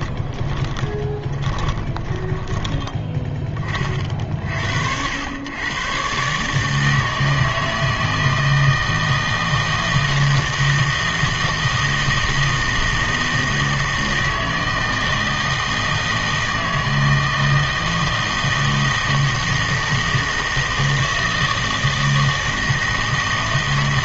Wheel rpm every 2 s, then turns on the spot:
20, 20, 60, 150, 160, 160, 160, 160, 160, 160, 160, 160.
0-4